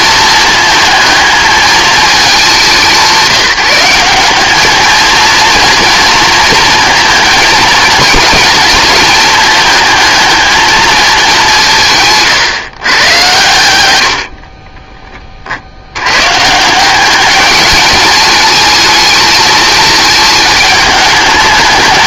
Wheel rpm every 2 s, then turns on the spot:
220, 200, 210, 230, 220, 220, 130, 30, 150, 210, 210.
14-16